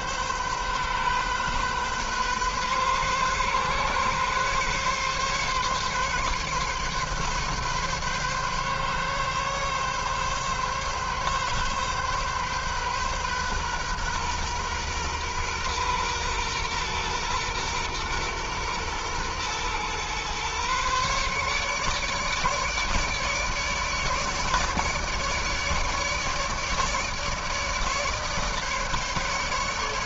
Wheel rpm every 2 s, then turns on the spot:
130, 130, 140, 140, 140, 140, 130, 120, 120, 120, 130, 150, 150, 150, 150.
none